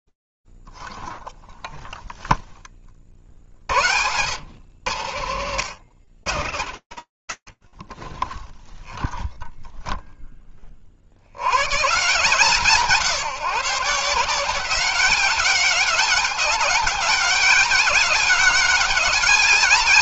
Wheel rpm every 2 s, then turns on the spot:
10, 10, 80, 110, 10, 40, 170, 190, 200, 190.
none